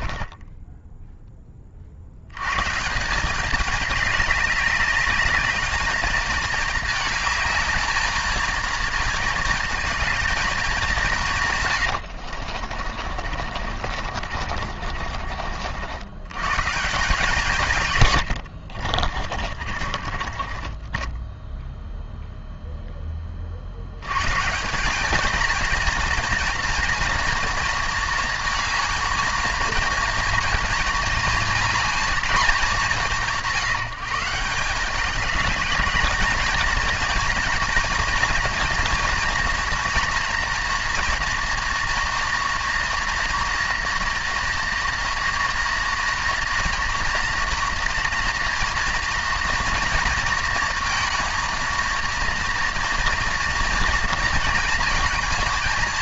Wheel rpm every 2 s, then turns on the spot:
20, 190, 210, 220, 230, 150, 50, 70, 160, 40, 0, 50, 230, 230, 230, 220, 170, 210, 230, 240, 230, 230, 230, 240, 230, 230, 230, 230.
12-14 18-20